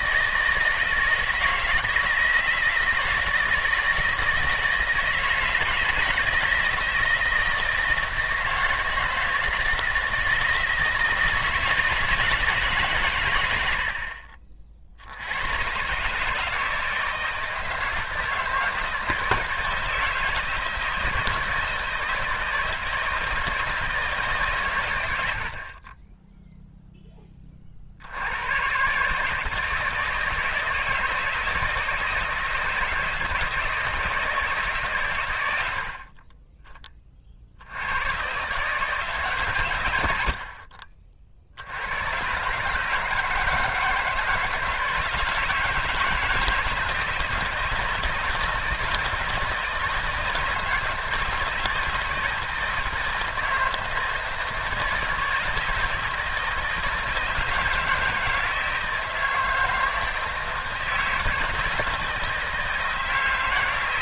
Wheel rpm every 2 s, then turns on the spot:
160, 160, 160, 160, 160, 160, 150, 50, 160, 160, 160, 170, 130, 0, 120, 160, 160, 150, 30, 150, 50, 150, 160, 160, 160, 160, 160, 160, 160, 160, 160, 160.
none